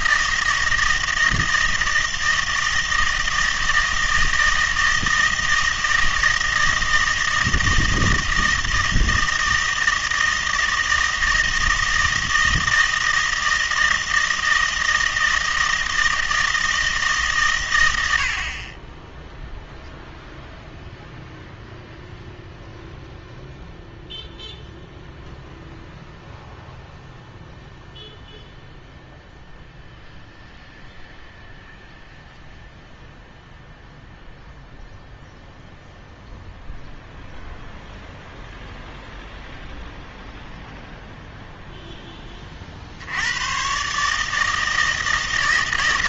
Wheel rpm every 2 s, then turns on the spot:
160, 160, 160, 160, 160, 160, 160, 160, 160, 30, 0, 0, 0, 0, 0, 0, 0, 0, 0, 0, 0, 40, 160.
none